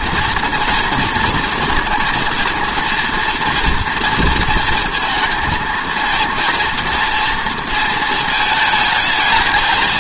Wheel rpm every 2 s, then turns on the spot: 230, 230, 230, 240, 220.
none